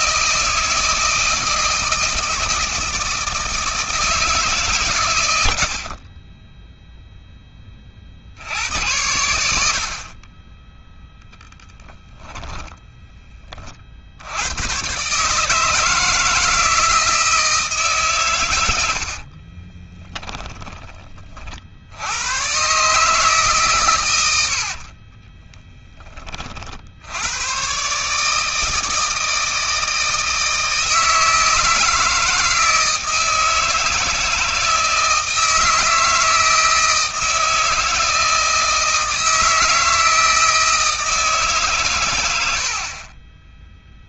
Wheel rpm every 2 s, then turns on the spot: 160, 160, 130, 0, 100, 10, 10, 120, 160, 70, 30, 140, 40, 80, 160, 160, 160, 160, 160, 160, 160, 40.
18-20 24-26